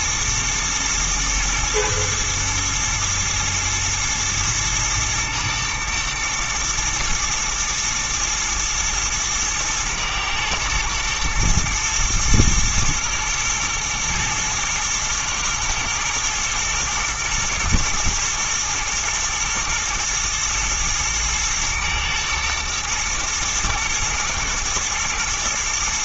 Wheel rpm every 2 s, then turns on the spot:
120, 110, 110, 110, 120, 110, 120, 110, 110, 110, 110, 120, 110.
none